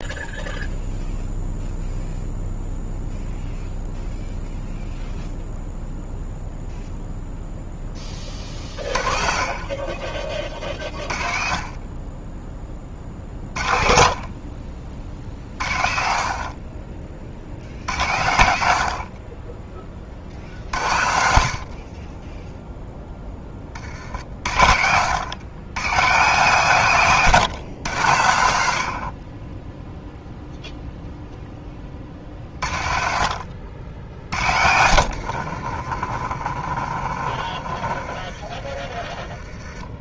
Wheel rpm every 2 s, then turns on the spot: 0, 0, 0, 0, 40, 30, 20, 40, 40, 70, 70, 0, 60, 140, 80, 0, 50, 60, 40, 30.
34-40